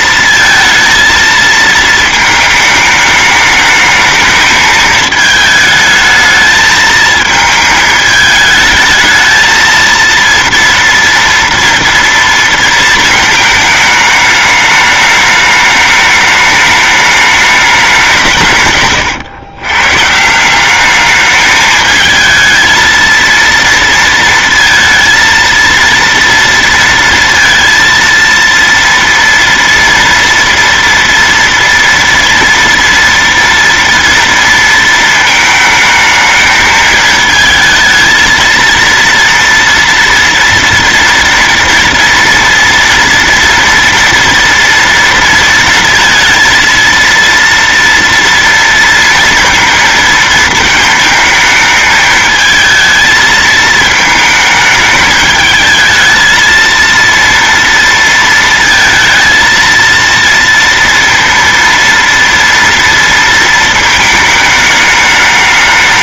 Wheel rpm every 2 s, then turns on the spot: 230, 210, 220, 220, 220, 230, 230, 210, 210, 140, 190, 220, 230, 230, 230, 230, 230, 230, 220, 230, 230, 230, 230, 230, 230, 220, 220, 220, 220, 230, 230, 230, 210.
none